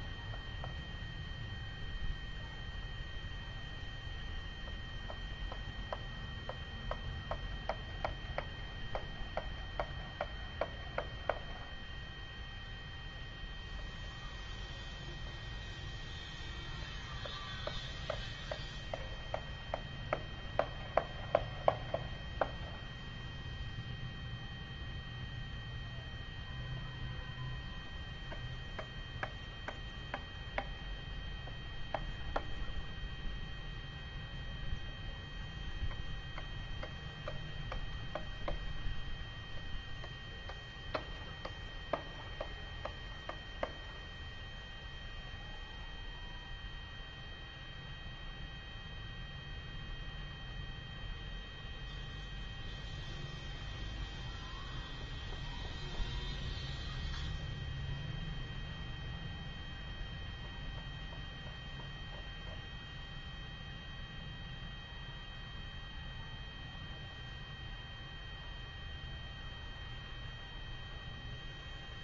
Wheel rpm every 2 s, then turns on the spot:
0, 0, 0, 0, 0, 0, 0, 0, 0, 0, 0, 0, 0, 0, 0, 0, 0, 0, 0, 0, 0, 0, 0, 0, 0, 0, 0, 0, 0, 0, 0, 0, 0, 0, 0, 0.
none